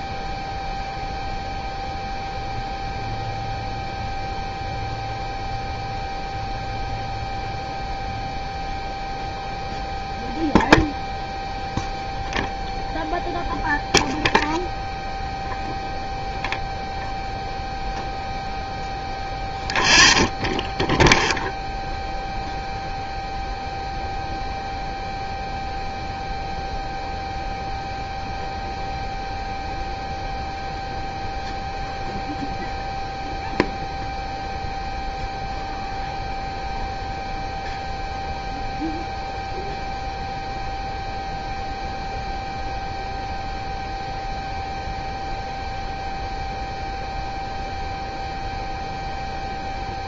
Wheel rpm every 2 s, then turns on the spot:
0, 0, 0, 0, 0, 0, 0, 0, 0, 0, 0, 0, 0, 0, 0, 0, 0, 0, 0, 0, 0, 0, 0, 0, 0.
none